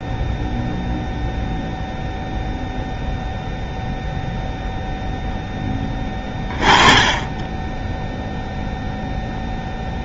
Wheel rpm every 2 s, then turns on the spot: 0, 0, 0, 20, 0.
none